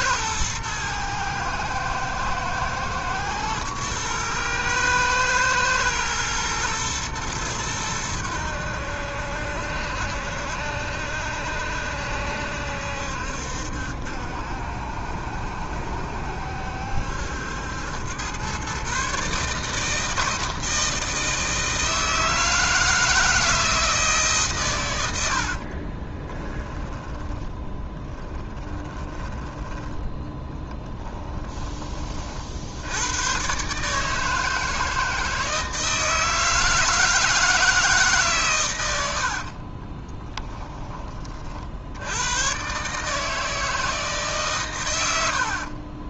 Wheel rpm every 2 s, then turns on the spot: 110, 120, 110, 110, 80, 70, 70, 70, 70, 120, 160, 160, 120, 20, 20, 10, 70, 160, 160, 110, 20, 130, 120.
26-32 40-42